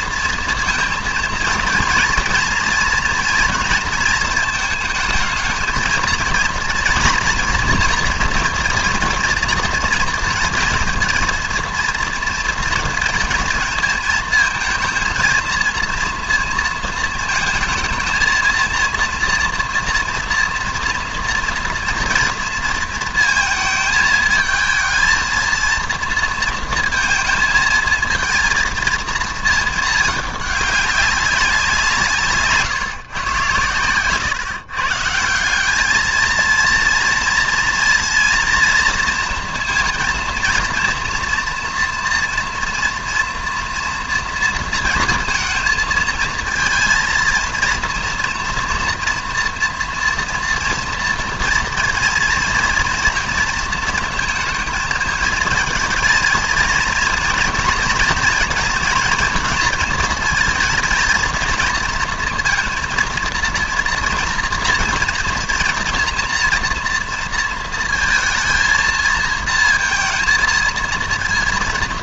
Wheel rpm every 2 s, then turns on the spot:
230, 230, 220, 230, 240, 230, 230, 220, 230, 230, 230, 230, 220, 230, 230, 200, 140, 160, 230, 230, 230, 230, 230, 230, 230, 230, 230, 230, 230, 230, 230, 230, 240, 230, 230, 230.
none